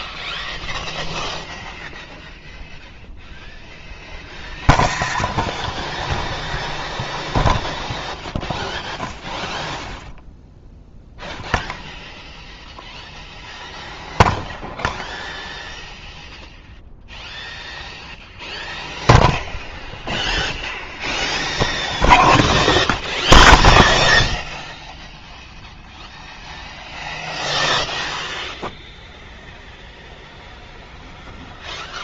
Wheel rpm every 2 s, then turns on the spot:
0, 0, 0, 0, 0, 0, 0, 0, 0, 0, 0, 0, 0, 0, 0, 0.
none